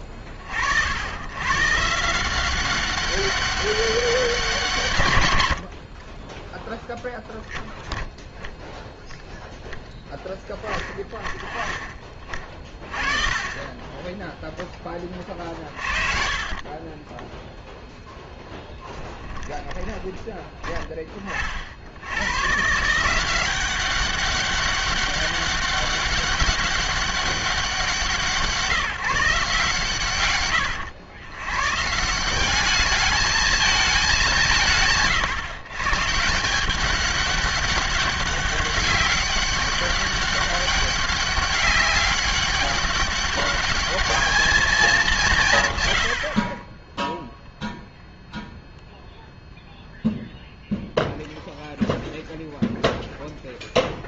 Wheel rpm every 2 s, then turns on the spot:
60, 190, 170, 10, 0, 10, 30, 10, 30, 10, 20, 140, 200, 200, 160, 110, 190, 170, 180, 200, 200, 200, 220, 40, 0, 0, 0.
16-20